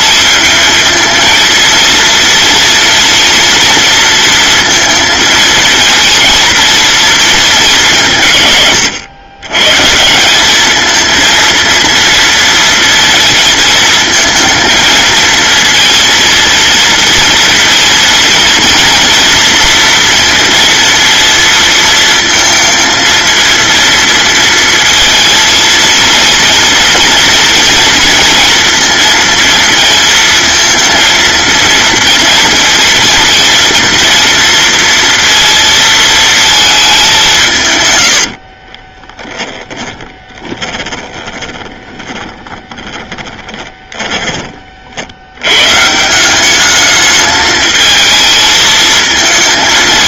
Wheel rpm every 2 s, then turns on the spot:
220, 230, 230, 220, 130, 200, 230, 230, 230, 230, 230, 230, 230, 230, 230, 230, 230, 230, 220, 40, 20, 20, 30, 200, 220.
38-44